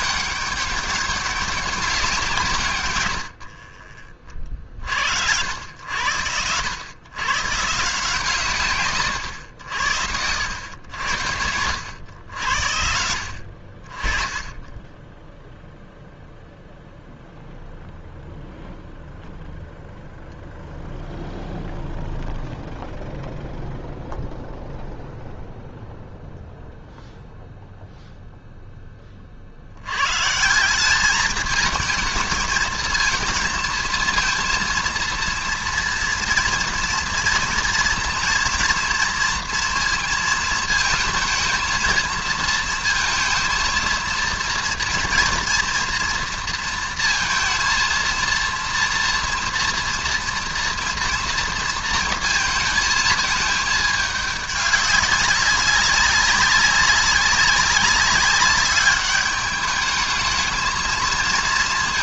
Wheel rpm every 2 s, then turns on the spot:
200, 160, 40, 100, 150, 90, 90, 20, 0, 0, 0, 0, 0, 0, 0, 170, 220, 230, 230, 230, 220, 230, 230, 230, 230, 230, 220, 200, 190, 200, 220.
none